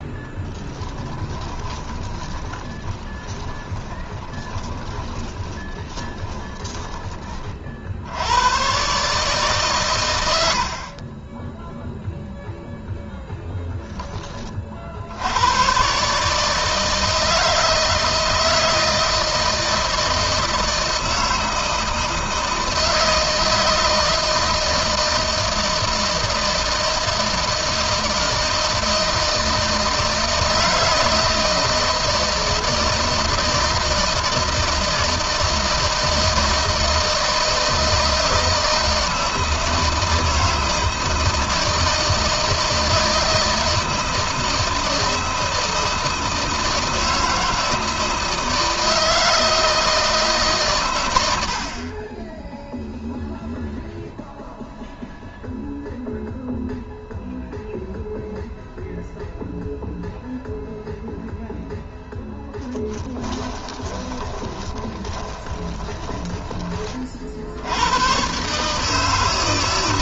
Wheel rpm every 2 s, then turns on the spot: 20, 20, 20, 30, 140, 50, 0, 60, 160, 160, 160, 160, 160, 160, 160, 160, 160, 160, 160, 160, 160, 160, 160, 160, 160, 110, 0, 0, 0, 0, 0, 10, 20, 40, 150.
0-6 62-66